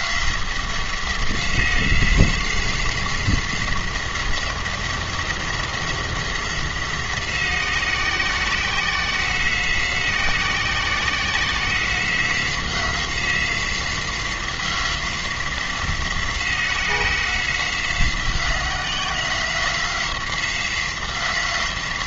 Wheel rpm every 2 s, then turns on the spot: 180, 180, 180, 180, 180, 180, 180, 180, 180, 180, 180.
none